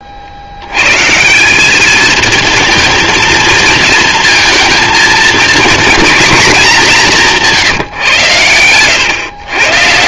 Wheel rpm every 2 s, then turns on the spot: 120, 230, 230, 200, 110.
none